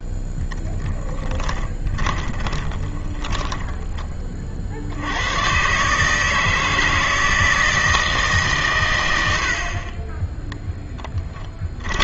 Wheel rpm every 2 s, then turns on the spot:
0, 20, 60, 160, 130, 0.
2-4